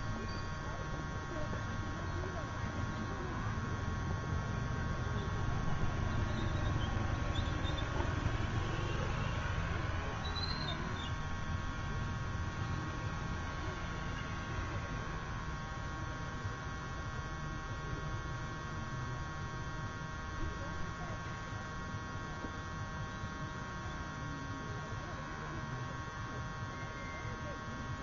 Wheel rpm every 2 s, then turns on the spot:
0, 0, 0, 0, 0, 0, 0, 0, 0, 0, 0, 0, 0, 0.
none